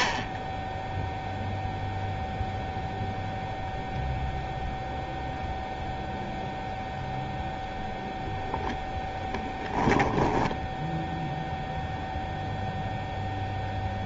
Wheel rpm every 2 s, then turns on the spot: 0, 0, 0, 0, 10, 10, 0.
none